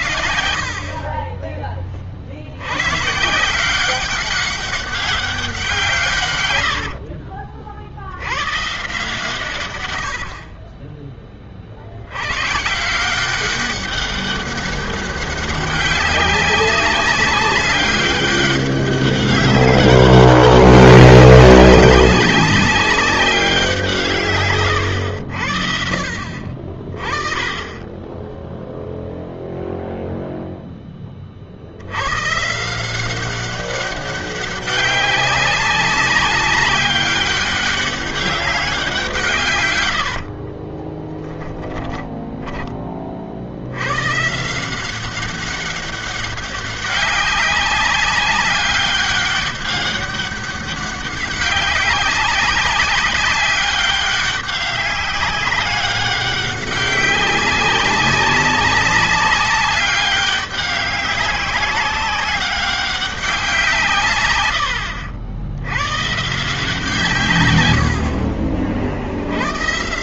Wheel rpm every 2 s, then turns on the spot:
40, 130, 190, 70, 140, 20, 150, 200, 200, 200, 200, 200, 120, 40, 0, 0, 130, 200, 200, 190, 60, 10, 150, 200, 200, 200, 190, 200, 200, 190, 200, 200, 100, 150, 60.
6-8 40-42 64-66